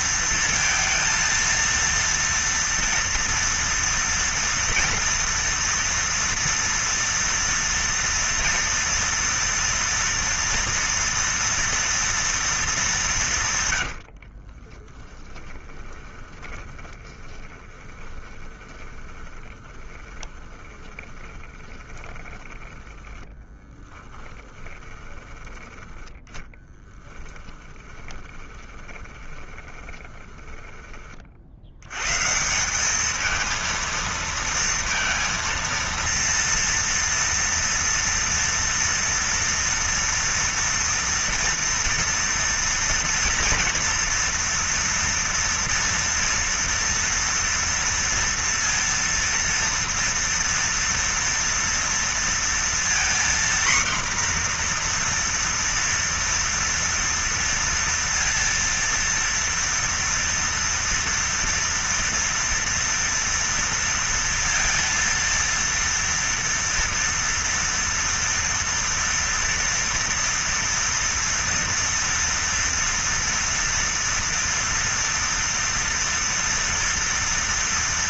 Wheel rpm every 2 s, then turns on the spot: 230, 230, 230, 230, 230, 230, 210, 30, 20, 20, 20, 10, 20, 10, 20, 20, 190, 230, 230, 230, 240, 230, 230, 230, 230, 230, 230, 240, 230, 230, 230, 230, 230, 230, 230, 230, 230, 230, 230.
14-30